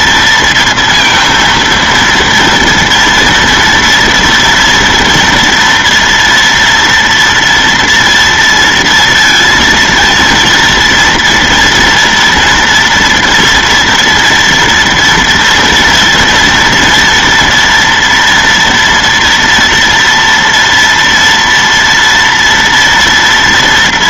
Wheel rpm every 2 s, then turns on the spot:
230, 230, 230, 240, 230, 230, 230, 230, 230, 230, 230, 230.
none